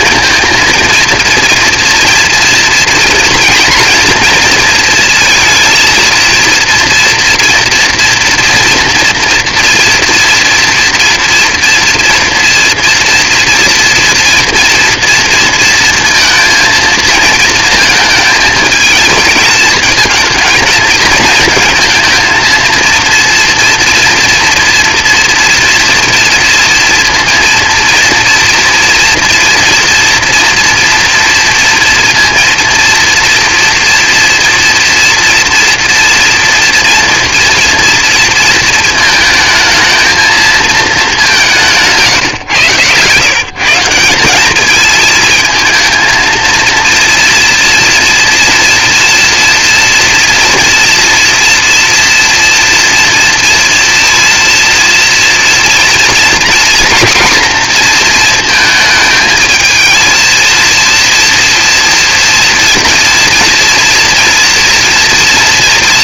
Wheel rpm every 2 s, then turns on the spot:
230, 240, 230, 230, 230, 240, 240, 230, 230, 220, 220, 230, 230, 230, 240, 230, 230, 230, 240, 220, 230, 150, 210, 230, 240, 230, 230, 230, 230, 220, 230, 230, 240.
none